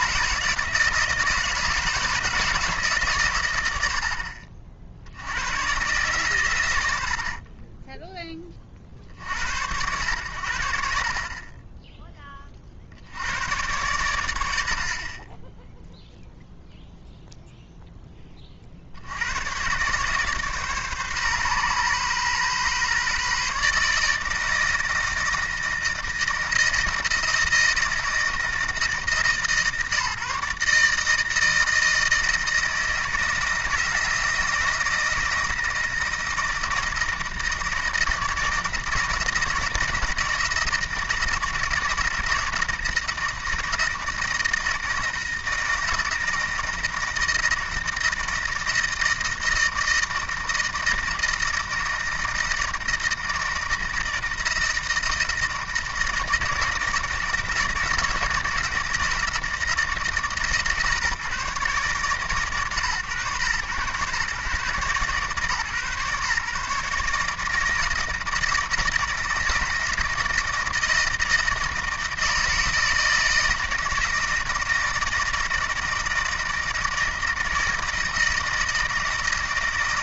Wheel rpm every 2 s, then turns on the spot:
160, 150, 60, 80, 50, 50, 70, 50, 0, 70, 140, 140, 160, 160, 160, 160, 160, 160, 160, 160, 160, 160, 160, 160, 160, 160, 160, 160, 160, 160, 140, 120, 140, 140, 160, 160, 160, 160, 160, 160.
none